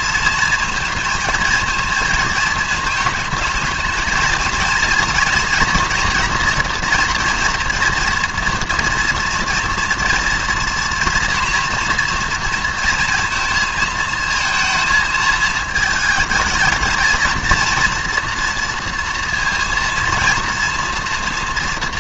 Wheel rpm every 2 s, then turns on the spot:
230, 220, 230, 240, 230, 230, 230, 220, 220, 230, 230.
none